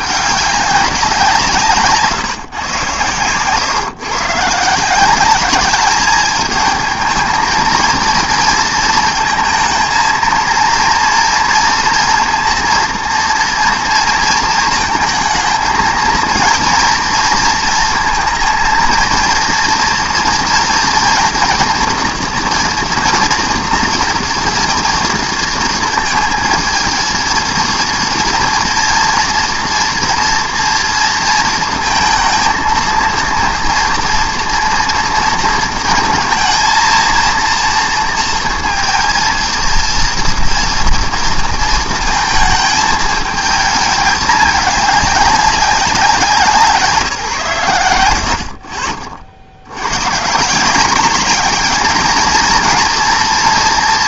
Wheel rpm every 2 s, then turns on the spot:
200, 130, 150, 220, 230, 230, 230, 220, 230, 230, 230, 230, 230, 230, 230, 230, 230, 230, 220, 230, 230, 220, 210, 180, 50, 170, 220.
none